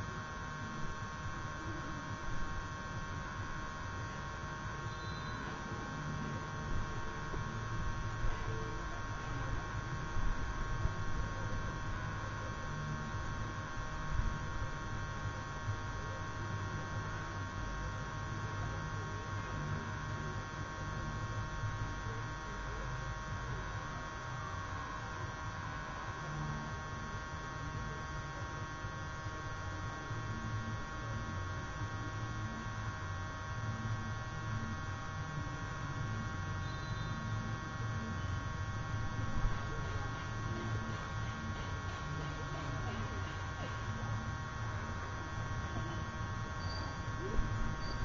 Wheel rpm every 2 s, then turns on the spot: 0, 0, 0, 0, 0, 0, 0, 0, 0, 0, 0, 0, 0, 0, 0, 0, 0, 0, 0, 0, 0, 0, 0, 0.
none